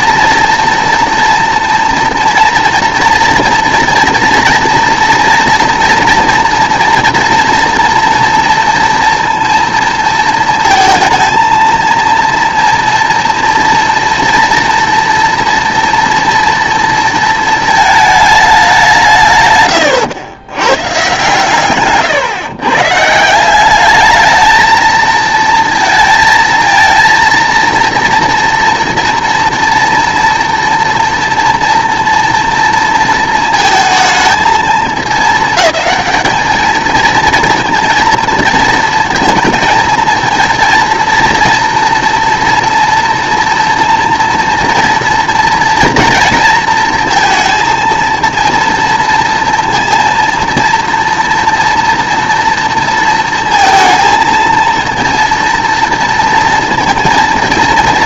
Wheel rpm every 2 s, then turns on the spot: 240, 230, 240, 230, 230, 230, 230, 230, 240, 200, 110, 130, 220, 230, 230, 230, 230, 220, 220, 230, 230, 230, 230, 230, 230, 230, 230, 230, 230.
none